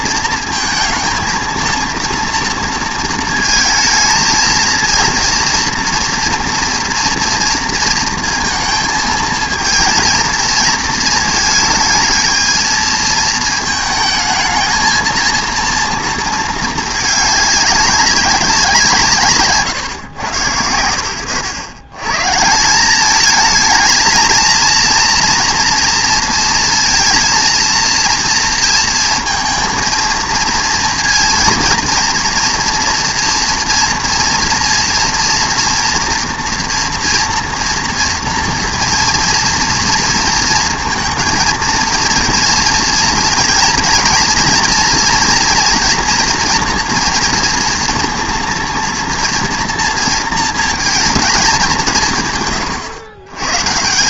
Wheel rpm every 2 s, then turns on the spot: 220, 230, 220, 230, 220, 230, 220, 230, 220, 170, 90, 180, 230, 230, 230, 230, 240, 230, 230, 240, 230, 230, 240, 230, 230, 220, 120.
none